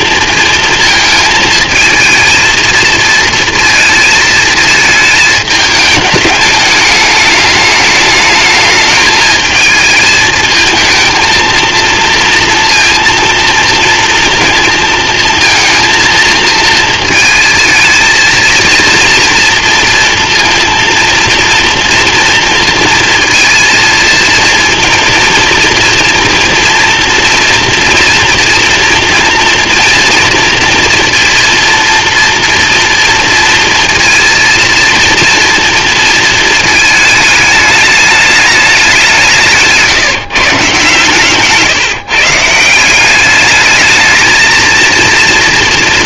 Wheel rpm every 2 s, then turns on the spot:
230, 220, 220, 210, 210, 220, 230, 220, 220, 230, 230, 230, 230, 230, 230, 230, 240, 230, 220, 200, 140, 170, 230.
none